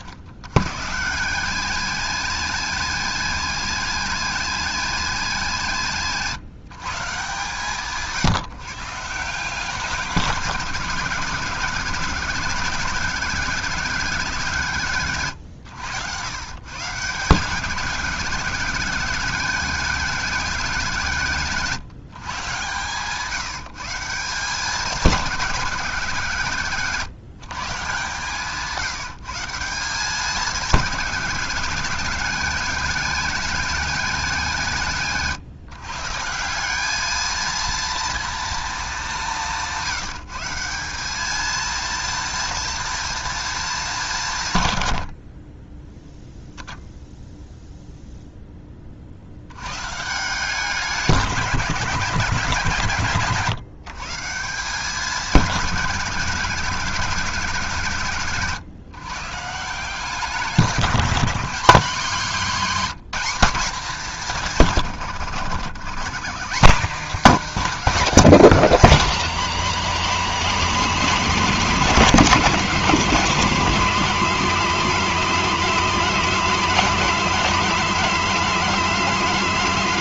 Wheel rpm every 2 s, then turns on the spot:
130, 230, 230, 150, 140, 170, 190, 150, 150, 200, 190, 140, 190, 160, 160, 210, 210, 160, 200, 220, 180, 230, 110, 0, 30, 190, 150, 180, 170, 130, 180, 220, 140, 240, 210, 200, 220, 220, 230, 230.
none